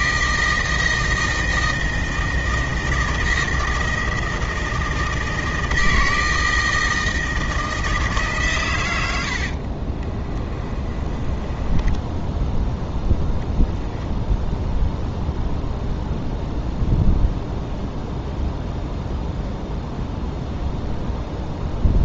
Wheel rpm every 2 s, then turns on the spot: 160, 160, 160, 160, 110, 30, 0, 0, 0, 0, 0.
10-12